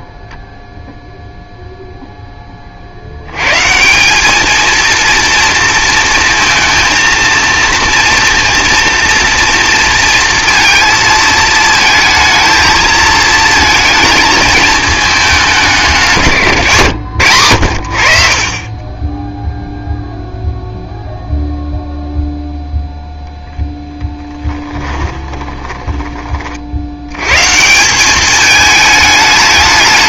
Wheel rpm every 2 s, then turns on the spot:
0, 30, 220, 230, 230, 230, 220, 220, 130, 40, 0, 0, 10, 50, 210.
24-26